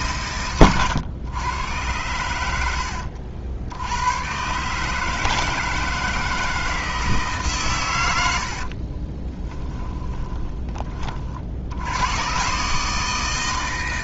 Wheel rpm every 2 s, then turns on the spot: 120, 80, 140, 160, 60, 20, 140.
0-2 8-10